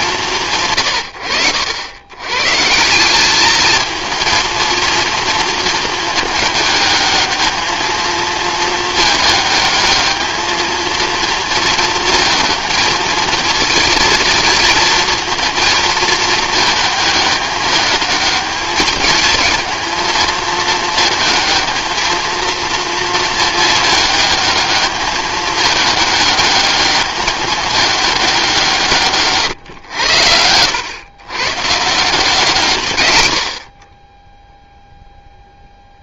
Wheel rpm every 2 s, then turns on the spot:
120, 150, 230, 210, 220, 220, 220, 230, 220, 210, 220, 230, 210, 210, 180, 90, 140, 0.
none